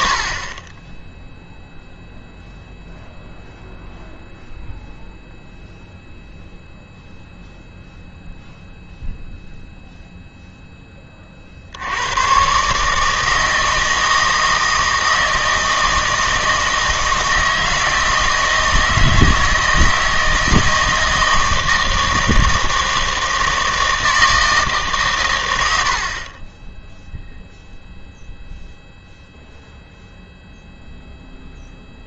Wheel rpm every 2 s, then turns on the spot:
20, 0, 0, 0, 0, 10, 150, 160, 160, 160, 160, 160, 150, 10, 0, 0.
none